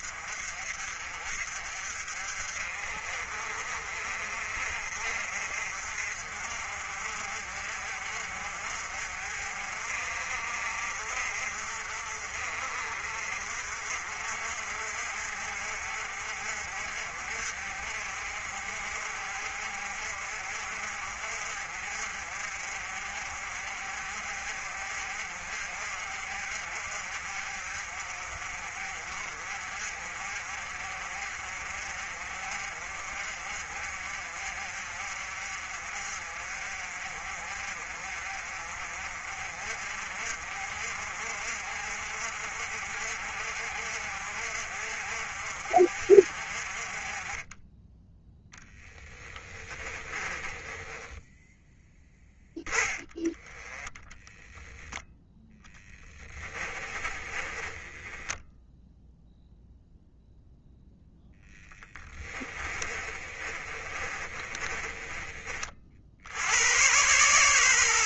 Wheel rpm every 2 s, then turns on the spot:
50, 50, 50, 50, 50, 50, 50, 50, 50, 50, 50, 50, 50, 50, 50, 50, 50, 50, 50, 50, 50, 50, 50, 30, 10, 20, 10, 0, 20, 0, 0, 30, 20, 110.
50-52 56-58 62-66